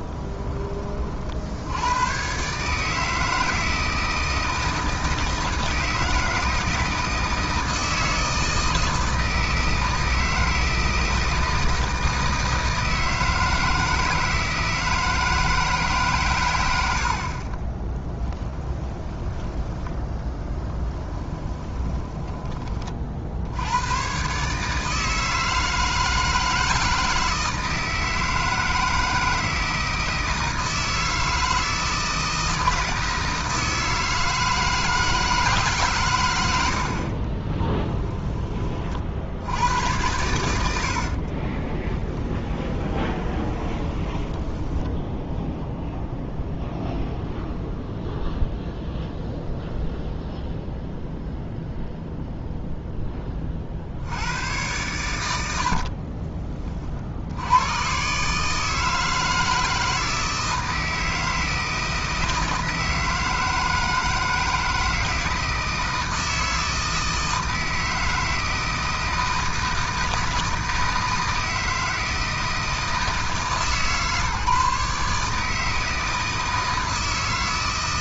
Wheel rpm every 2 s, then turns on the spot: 30, 150, 160, 160, 160, 160, 160, 160, 80, 10, 10, 40, 150, 160, 160, 160, 160, 160, 50, 40, 80, 20, 10, 0, 0, 0, 10, 100, 50, 160, 160, 160, 160, 160, 160, 160, 160, 150, 160.
20-22 40-46